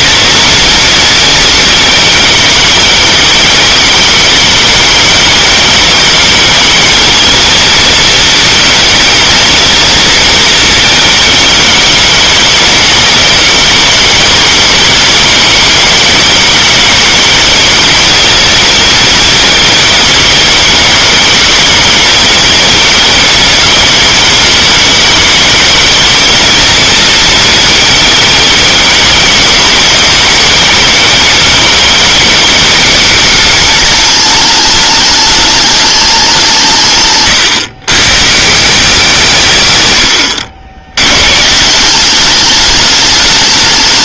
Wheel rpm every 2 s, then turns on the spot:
230, 210, 210, 210, 230, 230, 210, 210, 210, 220, 220, 220, 210, 230, 220, 220, 210, 210, 170, 160, 80, 210.
none